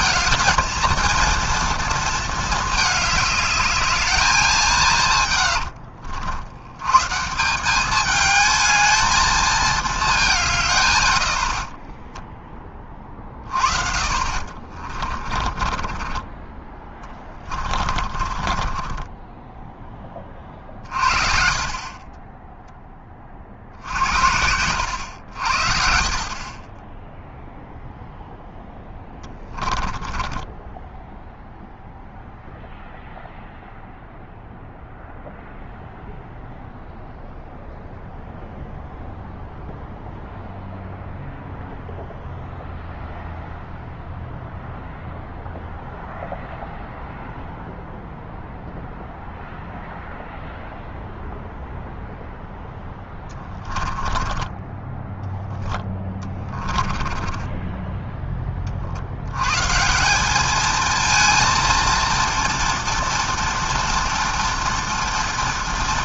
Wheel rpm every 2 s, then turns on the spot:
230, 220, 160, 110, 220, 140, 20, 50, 20, 30, 40, 10, 80, 10, 10, 10, 0, 0, 0, 0, 0, 0, 0, 0, 0, 0, 10, 20, 20, 40, 220, 230, 230.
14-16 18-22 28-32 52-58